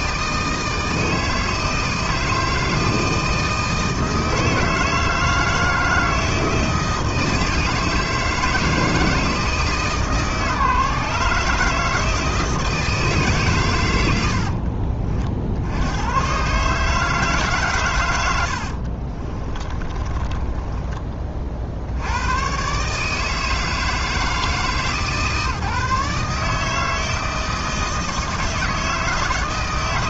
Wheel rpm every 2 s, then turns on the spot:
160, 160, 160, 160, 160, 150, 160, 50, 150, 60, 20, 140, 160, 160, 160.
18-22